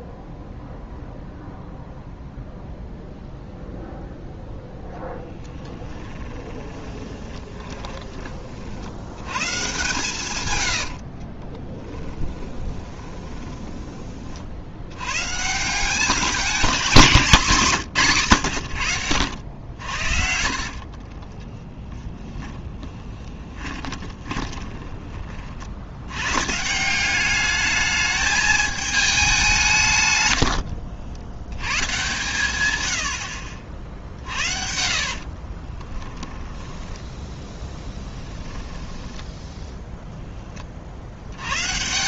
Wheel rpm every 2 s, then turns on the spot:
0, 0, 0, 20, 60, 90, 20, 80, 200, 110, 60, 20, 20, 170, 220, 80, 100, 60, 10, 10, 40.
6-8 10-14 20-26 30-32 34-38